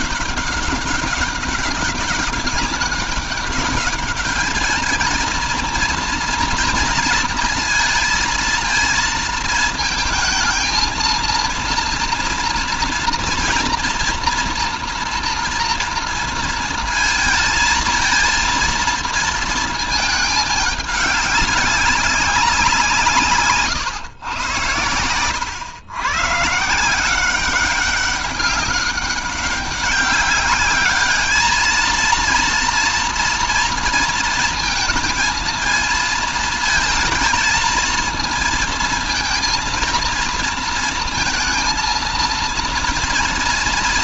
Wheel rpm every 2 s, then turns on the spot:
200, 200, 220, 230, 230, 230, 230, 230, 230, 230, 200, 170, 100, 170, 200, 210, 230, 230, 230, 230, 230, 230.
none